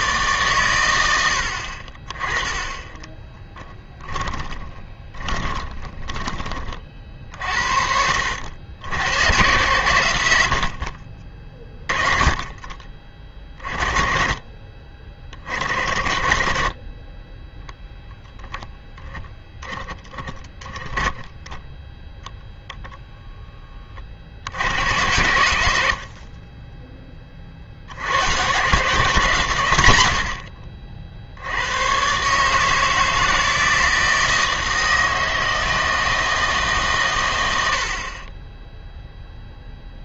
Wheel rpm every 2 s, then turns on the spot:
110, 20, 20, 30, 90, 70, 40, 30, 40, 0, 10, 0, 90, 20, 140, 60, 160, 160, 160, 0.
2-6